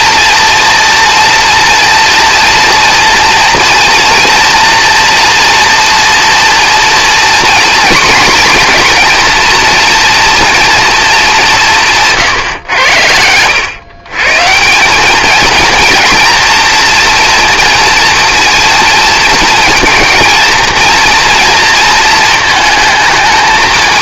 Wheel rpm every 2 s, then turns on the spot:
240, 230, 240, 240, 240, 230, 120, 160, 230, 230, 230, 220.
none